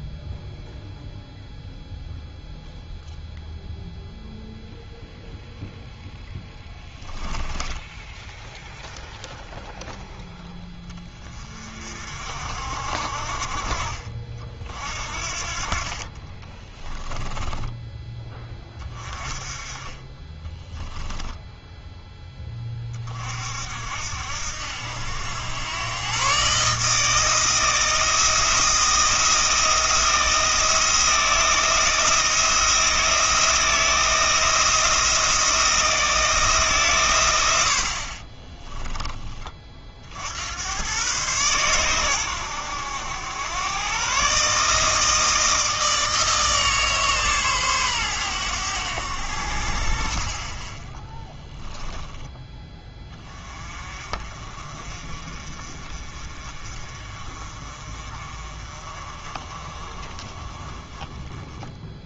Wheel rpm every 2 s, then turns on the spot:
0, 0, 0, 10, 0, 20, 50, 50, 20, 20, 10, 40, 80, 150, 170, 170, 170, 170, 140, 10, 110, 90, 160, 150, 90, 10, 20, 40, 40, 30, 20.
6-8 16-18 20-22